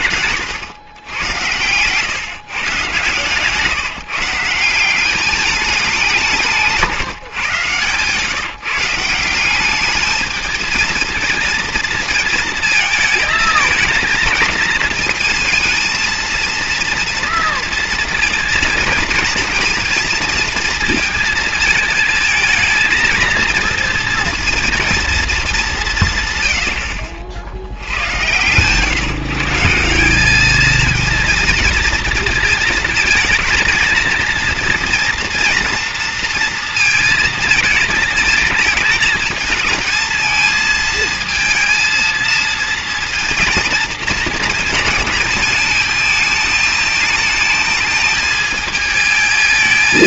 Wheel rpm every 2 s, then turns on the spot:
120, 150, 190, 160, 160, 220, 220, 220, 230, 230, 230, 230, 230, 100, 130, 220, 220, 230, 230, 220, 220, 230, 220, 220, 220.
6-8